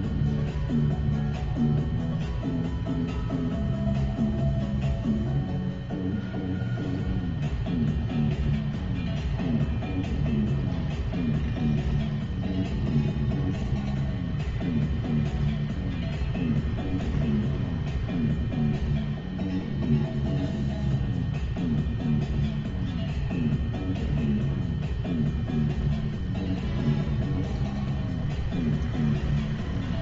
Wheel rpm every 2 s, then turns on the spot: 0, 0, 0, 0, 0, 0, 0, 0, 0, 0, 0, 0, 0, 0, 0.
none